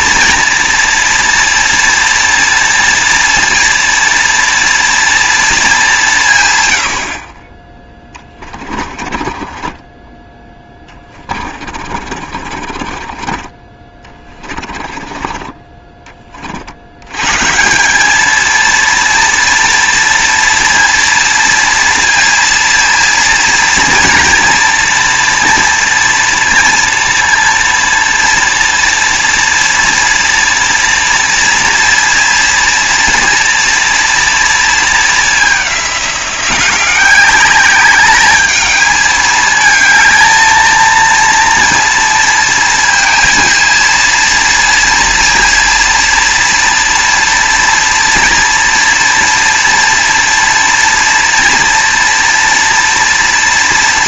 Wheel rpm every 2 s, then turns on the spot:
240, 230, 230, 120, 20, 20, 40, 20, 50, 230, 230, 230, 230, 230, 230, 230, 230, 230, 180, 210, 220, 230, 230, 230, 230, 230, 230.
8-16